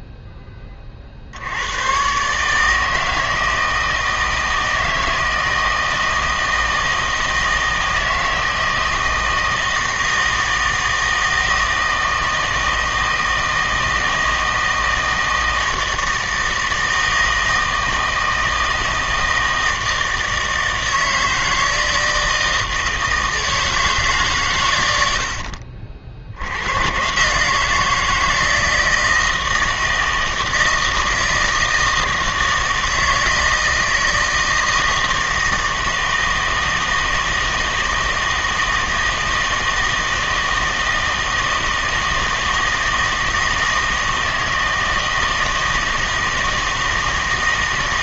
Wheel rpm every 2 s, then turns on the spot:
20, 150, 160, 160, 160, 160, 160, 160, 160, 160, 160, 160, 120, 90, 160, 160, 160, 160, 160, 160, 160, 160, 160, 160.
none